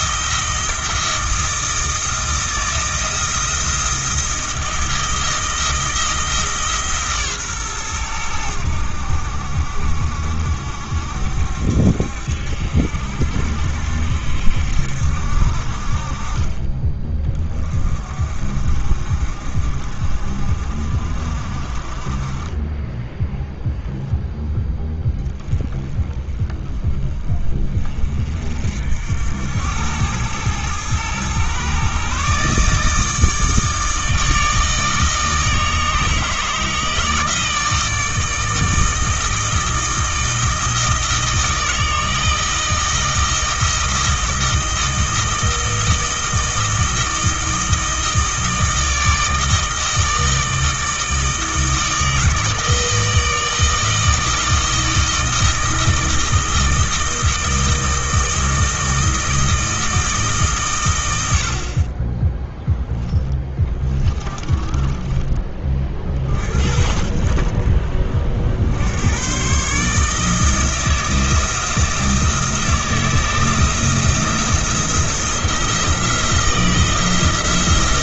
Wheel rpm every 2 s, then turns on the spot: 160, 160, 160, 150, 80, 70, 70, 70, 30, 50, 50, 10, 10, 20, 60, 110, 150, 160, 160, 160, 160, 160, 160, 160, 160, 160, 160, 160, 160, 160, 120, 0, 30, 50, 80, 160, 160, 170, 160.
64-66